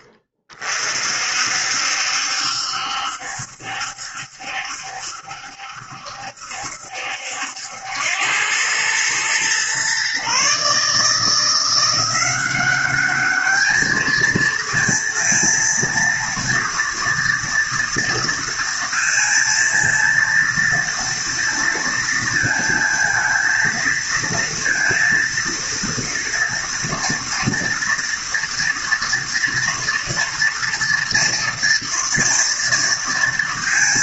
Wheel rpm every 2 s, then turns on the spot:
50, 70, 70, 70, 100, 140, 190, 230, 230, 230, 230, 230, 230, 230, 240, 230, 230.
none